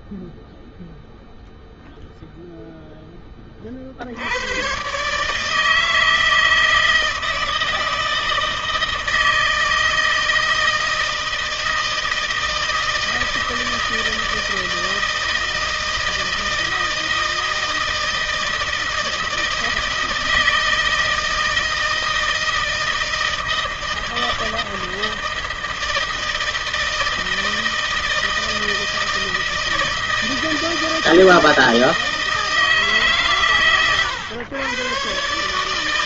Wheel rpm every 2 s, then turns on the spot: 0, 10, 130, 160, 160, 160, 160, 160, 160, 160, 160, 160, 160, 160, 160, 160, 150, 120.
none